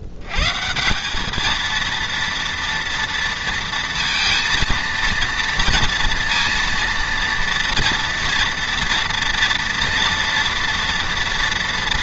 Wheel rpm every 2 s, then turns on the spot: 150, 230, 230, 230, 230, 230.
none